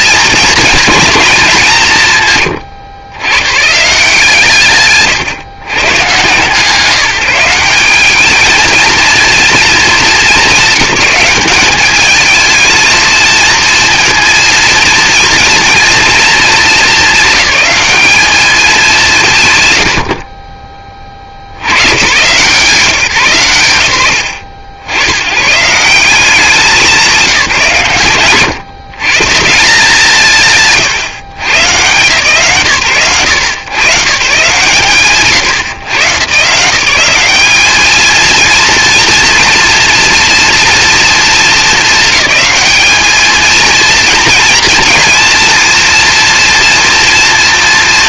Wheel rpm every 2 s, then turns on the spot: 230, 120, 140, 170, 230, 200, 220, 230, 220, 200, 40, 140, 90, 190, 140, 150, 130, 130, 180, 230, 230, 210, 230, 230.
none